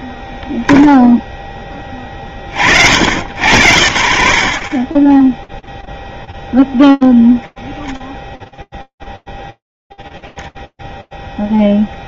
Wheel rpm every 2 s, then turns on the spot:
10, 60, 0, 0, 0, 0.
none